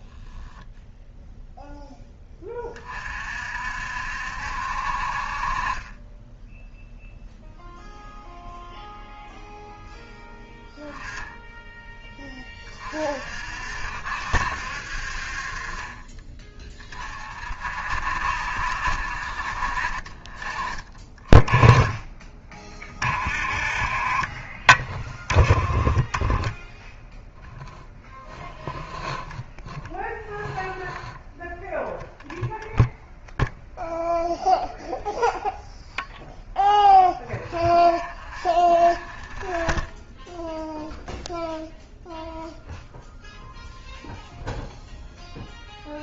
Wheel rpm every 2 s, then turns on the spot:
0, 30, 50, 0, 0, 10, 30, 60, 30, 60, 20, 30, 20, 0, 0, 0, 0, 0, 0, 0, 0, 0, 0.
none